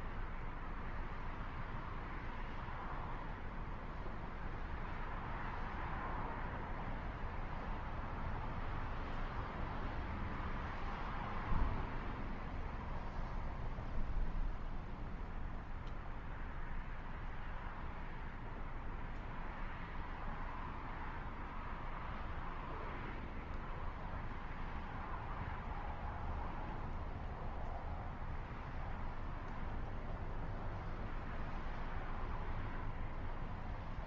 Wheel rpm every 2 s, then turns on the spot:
0, 0, 0, 0, 0, 0, 0, 0, 0, 0, 0, 0, 0, 0, 0, 0, 0.
none